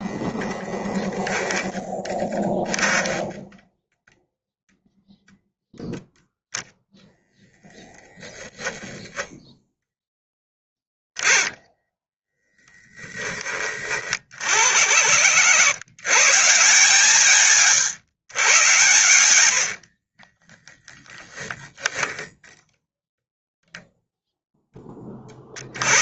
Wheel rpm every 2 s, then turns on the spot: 0, 10, 0, 0, 0, 10, 0, 70, 160, 120, 10, 0, 10.
none